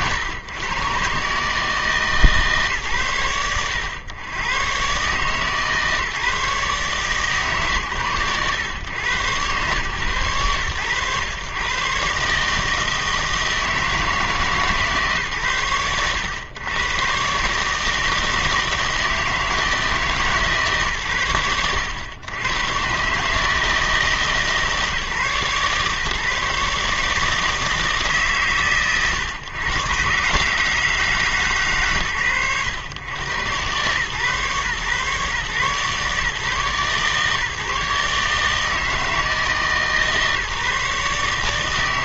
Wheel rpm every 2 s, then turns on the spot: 120, 130, 120, 150, 110, 120, 160, 160, 110, 160, 120, 120, 150, 150, 120, 150, 110, 140, 140, 150, 150.
none